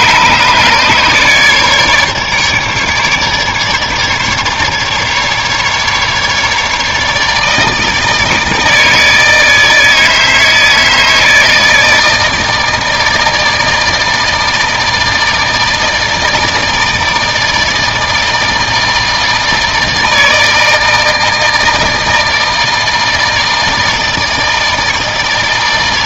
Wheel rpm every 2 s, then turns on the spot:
150, 150, 150, 150, 160, 160, 160, 160, 160, 160, 160, 160, 160.
none